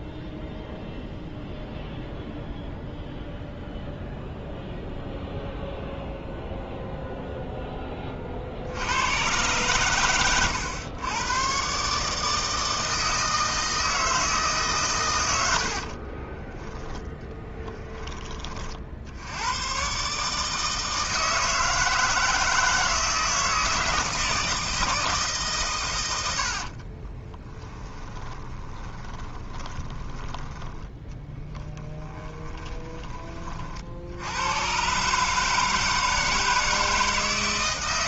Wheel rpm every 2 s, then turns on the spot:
0, 0, 0, 0, 80, 110, 160, 130, 10, 50, 160, 160, 160, 50, 20, 10, 20, 130, 160.
26-30